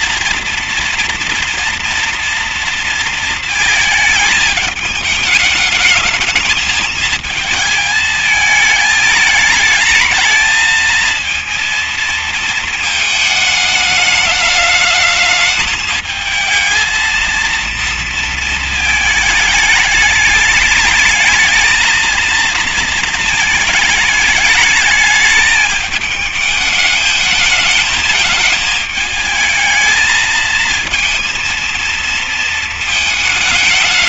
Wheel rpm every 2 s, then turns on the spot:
230, 230, 220, 220, 220, 220, 220, 210, 220, 230, 210, 230, 210, 220, 220, 220, 230.
none